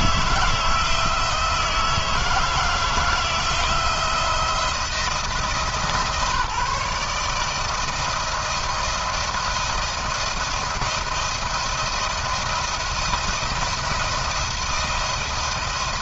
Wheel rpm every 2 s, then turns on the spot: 160, 160, 170, 150, 170, 160, 170, 170.
none